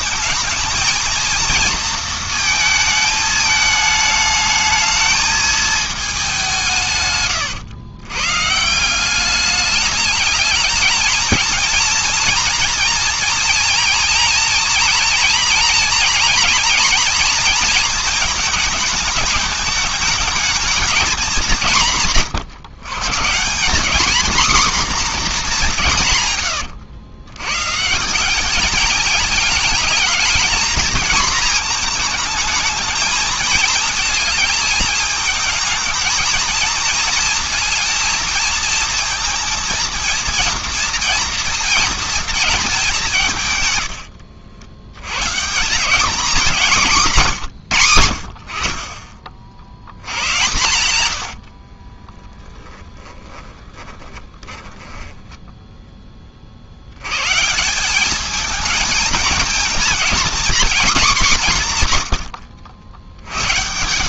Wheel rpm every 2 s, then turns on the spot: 220, 230, 220, 170, 150, 220, 230, 230, 240, 220, 220, 130, 250, 110, 210, 230, 220, 220, 230, 230, 230, 220, 90, 200, 40, 110, 30, 20, 50, 220, 240, 80.
26-28 52-56